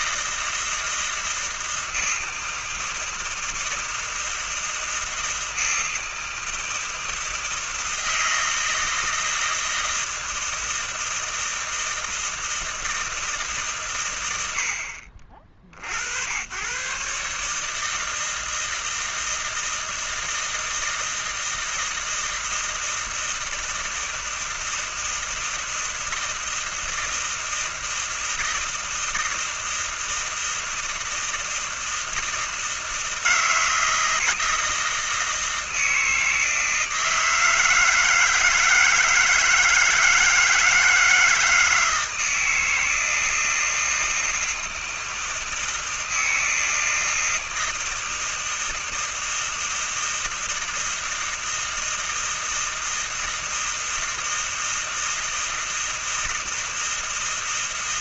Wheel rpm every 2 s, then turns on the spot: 160, 160, 160, 160, 160, 160, 160, 120, 70, 160, 160, 160, 160, 160, 160, 160, 160, 160, 160, 160, 160, 160, 160, 160, 160, 160, 160, 160, 160.
none